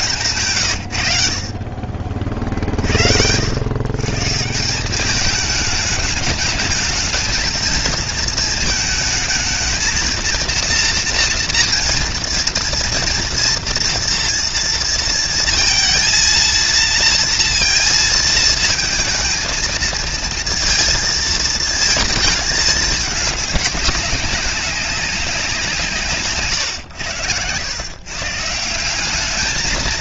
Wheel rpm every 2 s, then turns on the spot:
110, 60, 180, 220, 220, 230, 230, 230, 230, 220, 230, 220, 190, 110, 180.
0-2